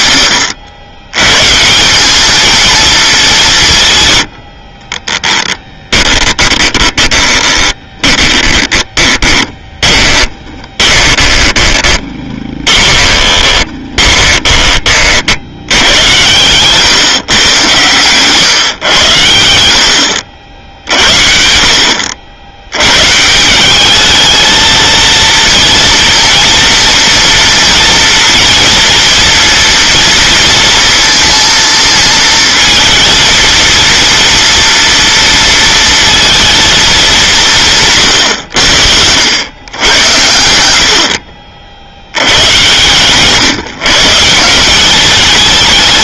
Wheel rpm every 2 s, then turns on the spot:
90, 220, 40, 20, 20, 20, 20, 30, 130, 120, 70, 110, 220, 230, 230, 230, 220, 230, 220, 80, 80, 120, 190.
6-14